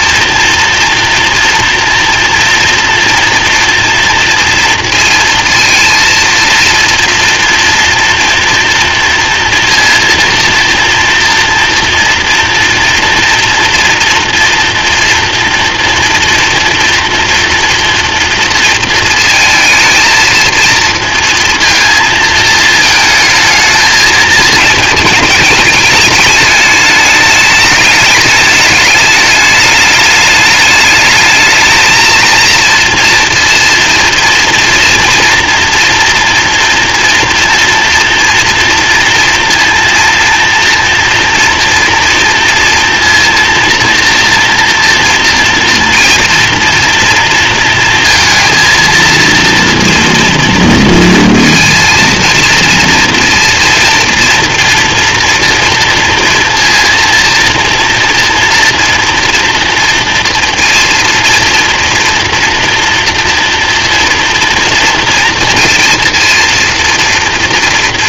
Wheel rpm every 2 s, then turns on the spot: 230, 230, 230, 230, 230, 230, 230, 230, 230, 230, 230, 220, 220, 210, 210, 210, 230, 230, 230, 230, 230, 230, 240, 240, 230, 230, 230, 230, 230, 230, 230, 230, 230, 230.
none